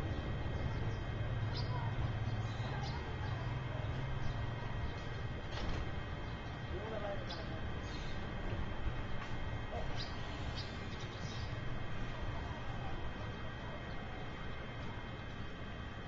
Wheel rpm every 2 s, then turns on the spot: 0, 0, 0, 0, 0, 0, 0, 0.
none